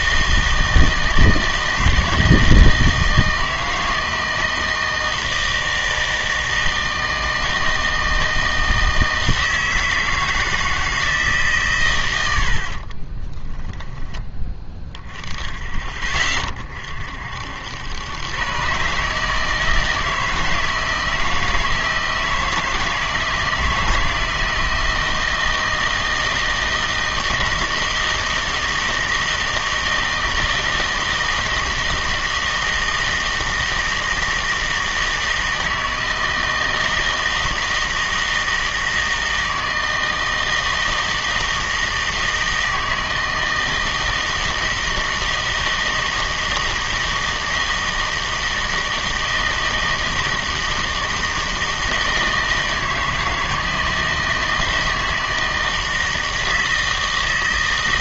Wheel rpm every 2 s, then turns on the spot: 160, 160, 160, 160, 160, 160, 70, 20, 30, 130, 160, 160, 160, 160, 160, 160, 160, 160, 160, 160, 160, 160, 160, 160, 160, 160, 160, 160, 160.
none